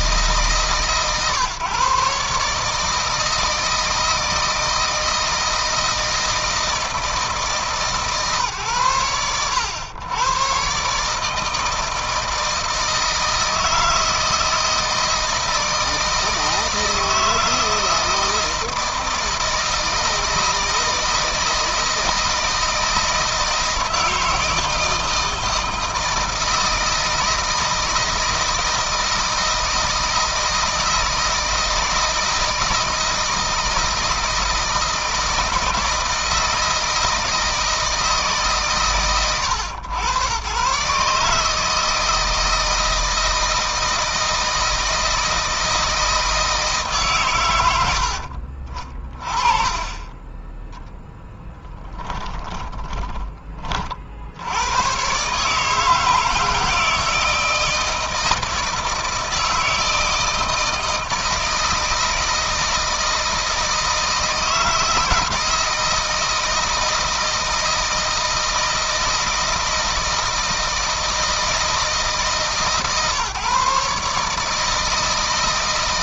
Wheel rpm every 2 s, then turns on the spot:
150, 150, 160, 160, 120, 130, 160, 160, 160, 160, 160, 160, 160, 160, 160, 160, 160, 160, 160, 140, 130, 160, 160, 150, 40, 10, 30, 110, 160, 160, 160, 160, 160, 160, 160, 160, 140, 160.
48-54